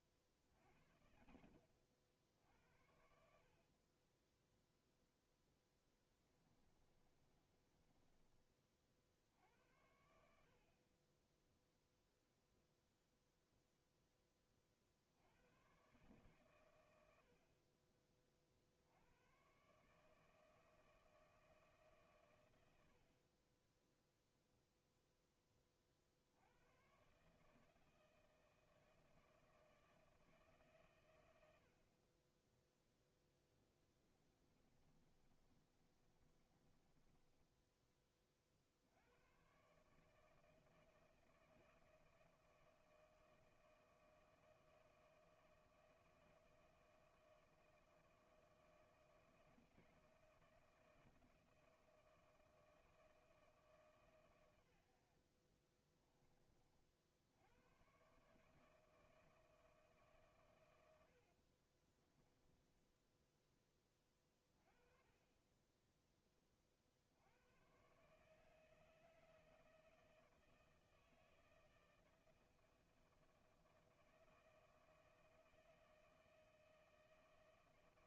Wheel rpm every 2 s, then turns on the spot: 50, 70, 0, 30, 40, 50, 0, 40, 110, 60, 160, 90, 0, 90, 160, 150, 10, 30, 20, 60, 160, 160, 160, 160, 160, 160, 160, 100, 40, 160, 110, 10, 30, 30, 160, 160, 160, 160, 160.
2-4 6-8 34-38 62-64